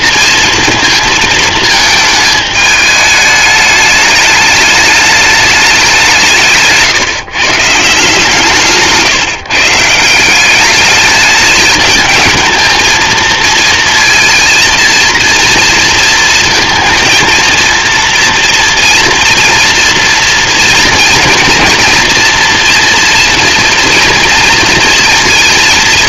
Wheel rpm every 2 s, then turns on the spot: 230, 220, 210, 150, 150, 210, 220, 230, 230, 230, 230, 230, 230.
none